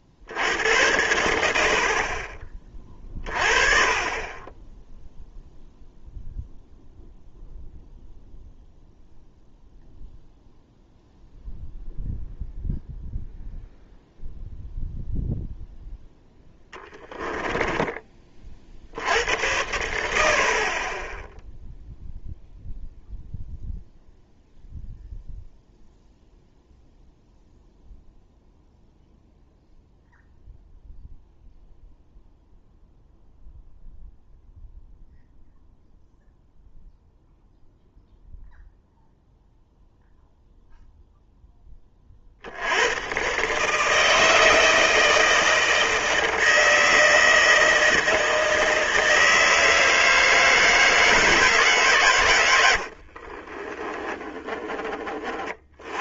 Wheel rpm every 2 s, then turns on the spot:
70, 30, 20, 0, 0, 0, 0, 0, 10, 50, 50, 0, 0, 0, 0, 0, 0, 0, 0, 0, 0, 70, 160, 160, 160, 160, 90, 10.
16-18 52-54